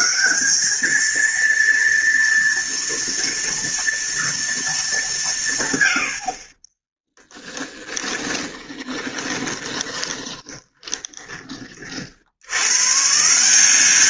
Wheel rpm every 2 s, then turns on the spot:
220, 230, 200, 10, 20, 20, 130.
6-12